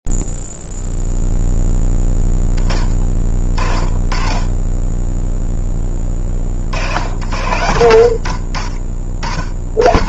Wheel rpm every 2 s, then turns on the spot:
0, 10, 40, 10, 60.
none